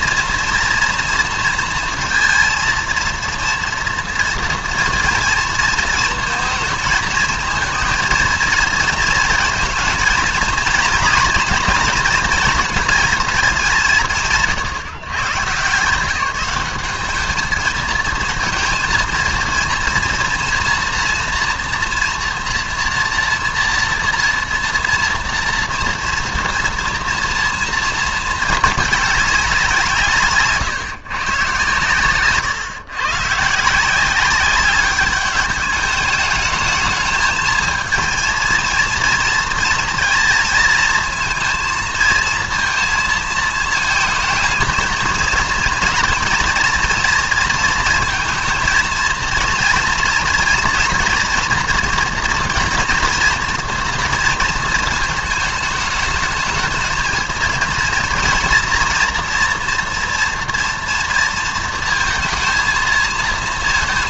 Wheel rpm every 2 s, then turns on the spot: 230, 230, 230, 220, 230, 230, 230, 140, 190, 220, 230, 240, 240, 230, 220, 140, 120, 200, 220, 230, 230, 230, 220, 230, 220, 230, 230, 230, 220, 230, 230, 220.
none